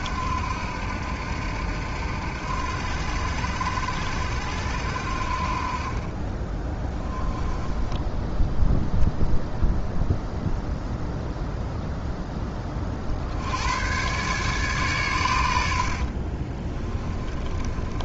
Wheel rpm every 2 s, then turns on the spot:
80, 80, 80, 20, 0, 0, 10, 130, 30.
16-18